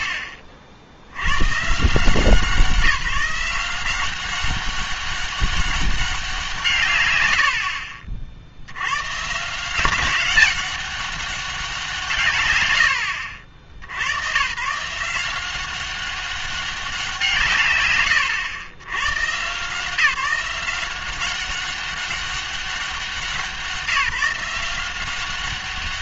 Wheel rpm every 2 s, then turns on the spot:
80, 170, 200, 170, 70, 200, 110, 130, 190, 120, 180, 190, 170.
none